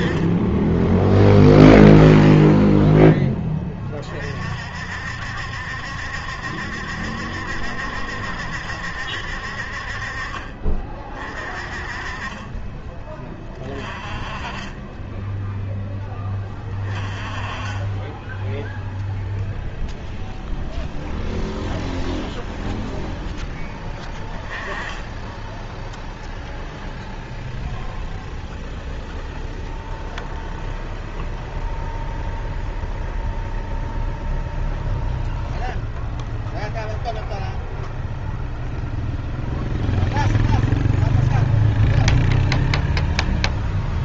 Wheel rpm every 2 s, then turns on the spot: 10, 10, 60, 70, 70, 30, 20, 10, 30, 0, 0, 0, 10, 0, 0, 0, 0, 0, 0, 0, 0, 0.
none